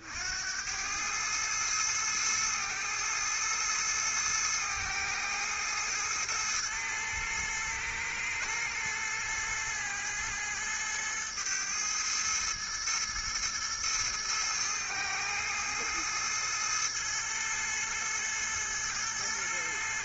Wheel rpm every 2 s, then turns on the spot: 80, 110, 110, 110, 110, 110, 110, 110, 110, 110.
none